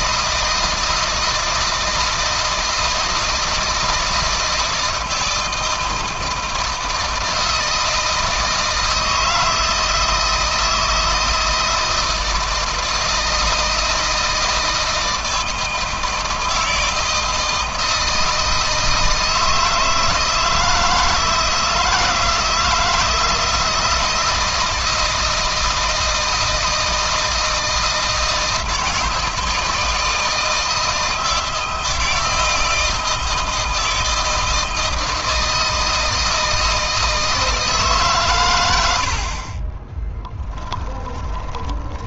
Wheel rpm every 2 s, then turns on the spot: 160, 160, 160, 160, 160, 160, 160, 160, 160, 160, 160, 160, 160, 160, 160, 160, 160, 160, 160, 80, 20.
40-42